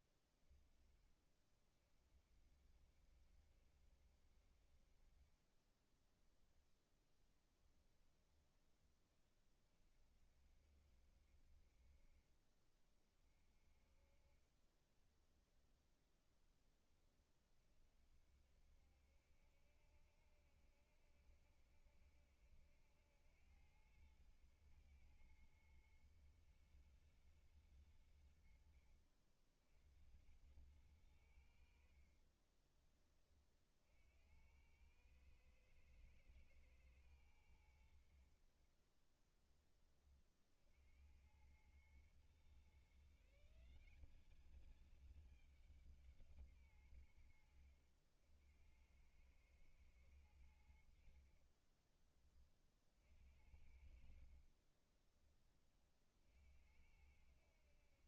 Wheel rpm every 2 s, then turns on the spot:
10, 50, 60, 10, 10, 50, 30, 30, 10, 50, 70, 70, 110, 110, 80, 80, 40, 90, 110, 60, 40, 120, 200, 160, 80, 90, 30, 40, 60.
6-8 14-16 32-34 54-56